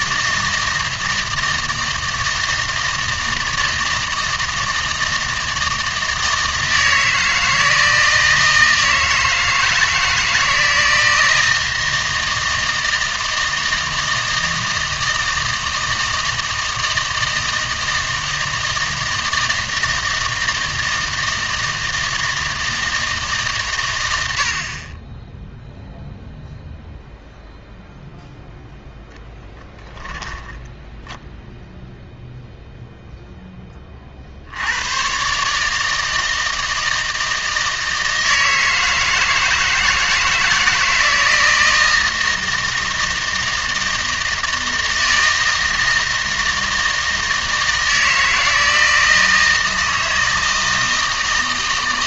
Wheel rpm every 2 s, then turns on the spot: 160, 160, 160, 160, 160, 160, 160, 160, 160, 160, 160, 160, 60, 0, 0, 10, 0, 80, 160, 160, 160, 160, 160, 160, 160, 160.
none